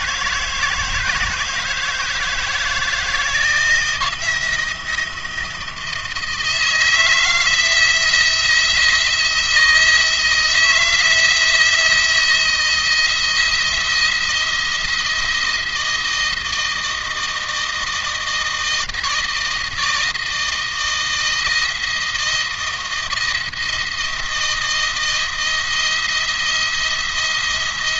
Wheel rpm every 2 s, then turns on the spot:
160, 160, 170, 160, 170, 160, 170, 170, 160, 160, 160, 170, 170, 170.
none